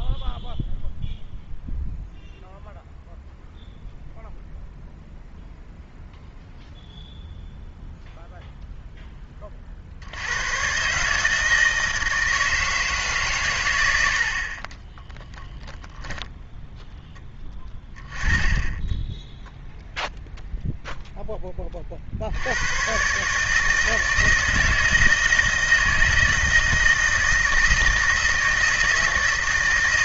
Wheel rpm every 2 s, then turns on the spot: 0, 0, 0, 0, 0, 130, 160, 30, 0, 10, 0, 100, 160, 160, 160.
none